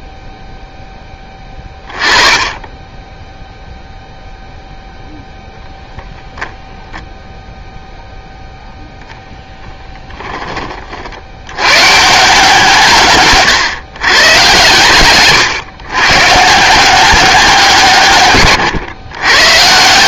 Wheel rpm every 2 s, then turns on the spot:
10, 10, 0, 0, 0, 40, 150, 130, 180, 120.
none